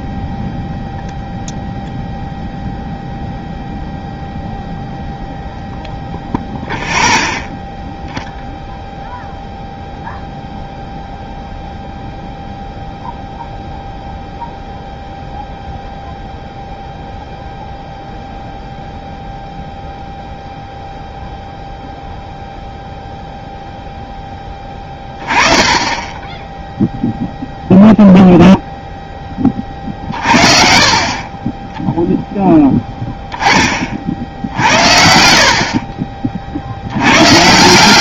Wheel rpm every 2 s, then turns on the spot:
0, 0, 0, 0, 0, 0, 0, 0, 0, 0, 0, 0, 20, 0, 0, 50, 10, 60, 80.
24-26 30-32